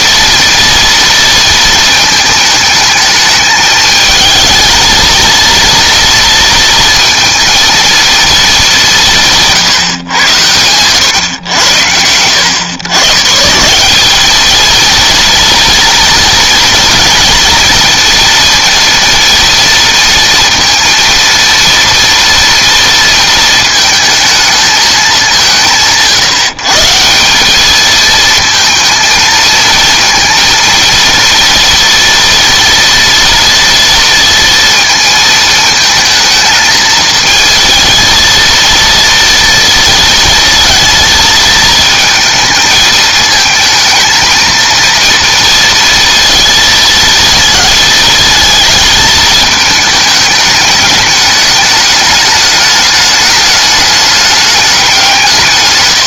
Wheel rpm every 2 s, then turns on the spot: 230, 220, 220, 230, 210, 110, 110, 230, 230, 230, 230, 230, 220, 160, 230, 230, 230, 230, 220, 230, 230, 220, 230, 230, 220, 210, 210, 200.
none